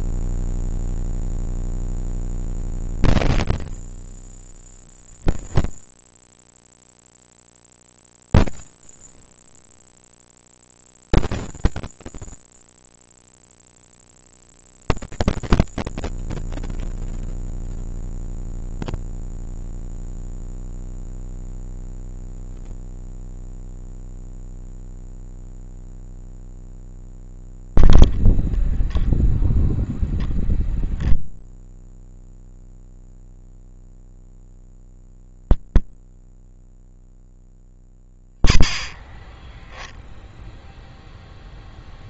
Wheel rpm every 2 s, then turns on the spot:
10, 50, 10, 40, 40, 60, 40, 170, 170, 20, 0, 10, 0, 10, 10, 0, 10, 10, 10, 10, 0.
8-10 12-14 18-20 26-28 32-36